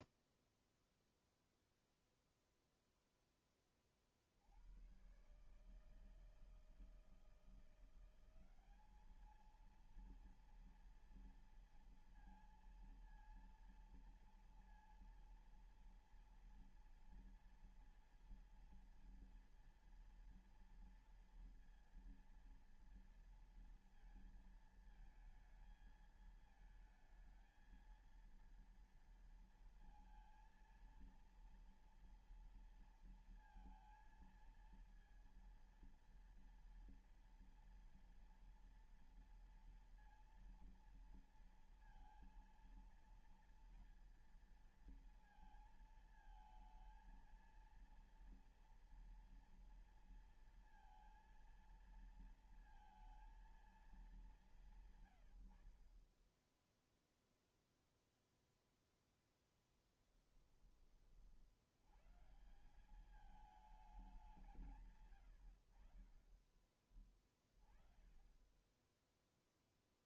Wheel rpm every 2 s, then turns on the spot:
0, 0, 50, 160, 180, 230, 230, 230, 230, 230, 230, 230, 220, 220, 230, 230, 230, 230, 230, 230, 230, 230, 230, 230, 230, 230, 230, 200, 20, 0, 10, 120, 190, 40, 20.
none